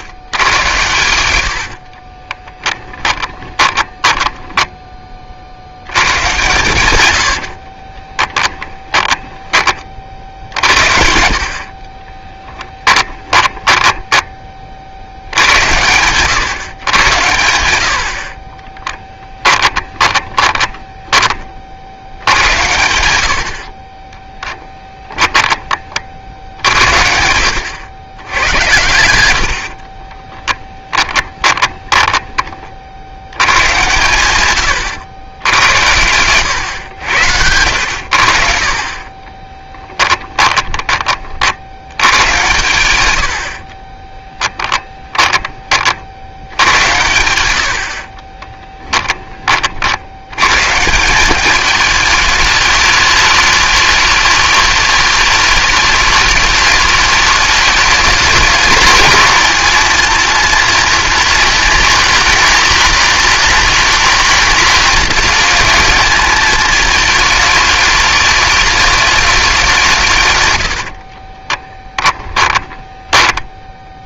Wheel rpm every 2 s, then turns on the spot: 100, 10, 20, 110, 10, 50, 10, 50, 130, 20, 10, 90, 10, 70, 100, 10, 40, 110, 100, 30, 20, 110, 10, 100, 20, 150, 210, 210, 210, 210, 230, 230, 230, 220, 210, 70, 10.
0-4 6-10 12-14 18-22 24-26 28-32 38-50 70-74